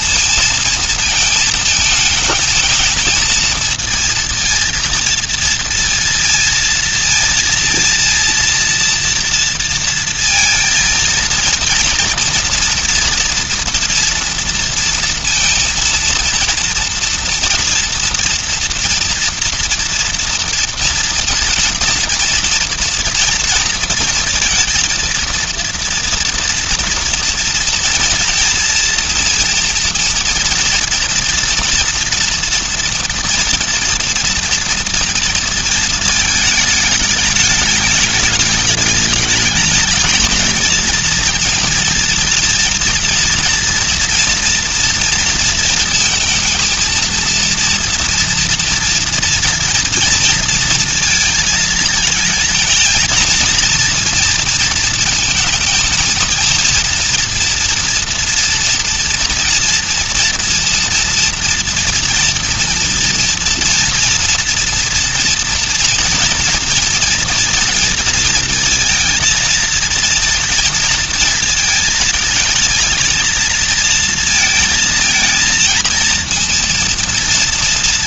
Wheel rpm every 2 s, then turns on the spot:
230, 220, 230, 230, 230, 230, 230, 230, 230, 240, 230, 230, 230, 230, 230, 230, 230, 230, 220, 210, 230, 230, 230, 230, 230, 230, 230, 230, 230, 230, 230, 230, 230, 230, 230, 230, 220, 230, 230.
none